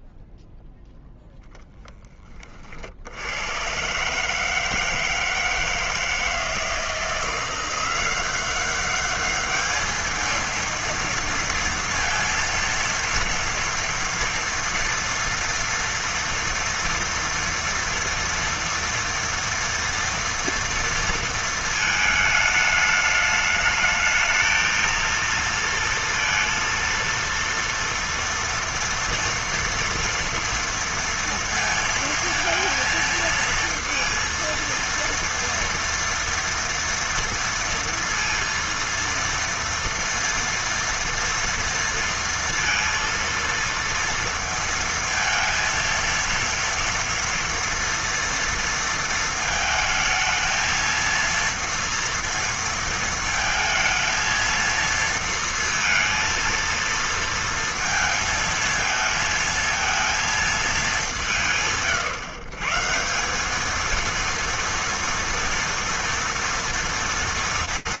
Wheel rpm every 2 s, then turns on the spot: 0, 30, 150, 160, 190, 230, 230, 230, 230, 240, 230, 220, 220, 230, 230, 230, 230, 230, 230, 230, 230, 230, 230, 230, 230, 220, 230, 220, 230, 230, 220, 130, 230, 230.
none